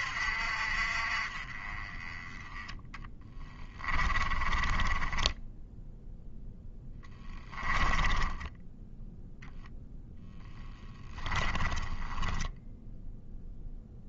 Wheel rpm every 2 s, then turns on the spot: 50, 10, 10, 10, 10, 10, 10.
2-8 10-12